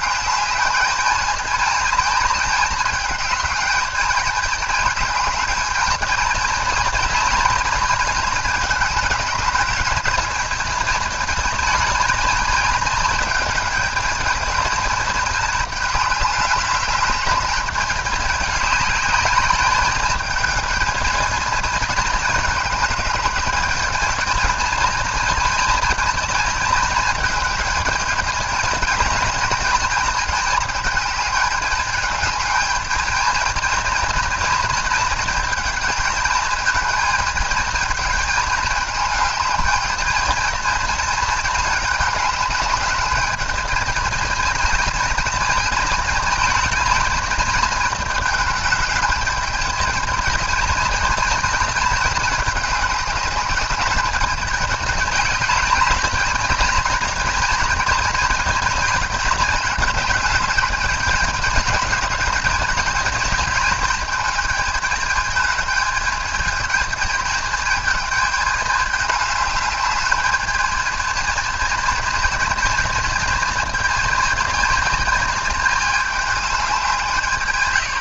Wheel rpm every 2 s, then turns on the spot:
210, 210, 210, 220, 220, 220, 220, 220, 210, 210, 220, 210, 220, 220, 220, 220, 220, 220, 220, 220, 220, 210, 220, 220, 220, 220, 210, 210, 220, 220, 220, 220, 220, 220, 210, 210, 220, 230, 210.
none